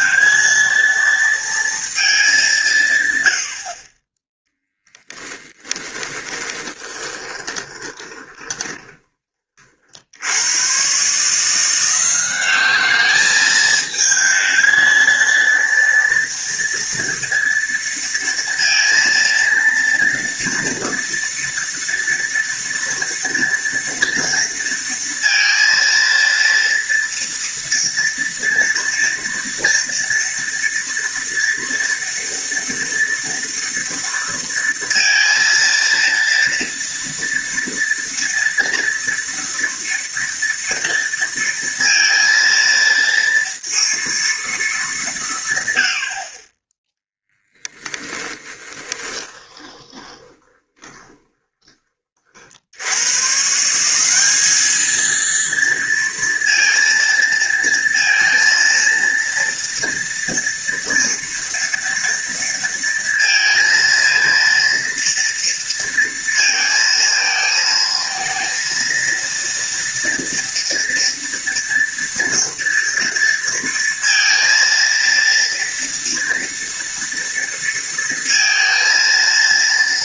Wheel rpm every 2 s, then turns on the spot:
230, 110, 10, 20, 20, 140, 210, 230, 230, 230, 230, 230, 230, 230, 230, 230, 230, 230, 230, 230, 230, 230, 190, 10, 20, 20, 120, 230, 230, 230, 230, 230, 230, 220, 230, 230, 230, 230, 230, 230.
6-8 48-52